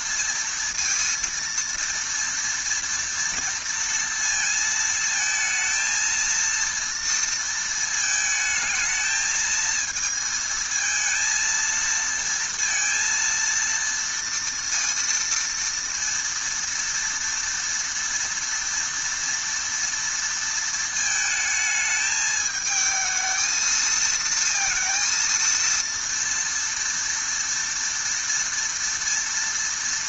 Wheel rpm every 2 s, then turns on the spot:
230, 230, 230, 230, 220, 230, 230, 230, 230, 230, 230, 220, 230, 230, 230.
none